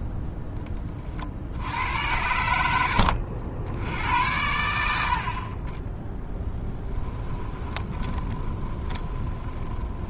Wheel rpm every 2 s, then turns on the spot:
10, 80, 60, 10, 20.
8-10